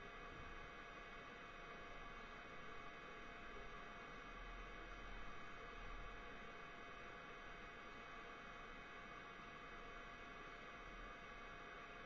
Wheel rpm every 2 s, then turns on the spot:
0, 0, 0, 0, 0, 0.
none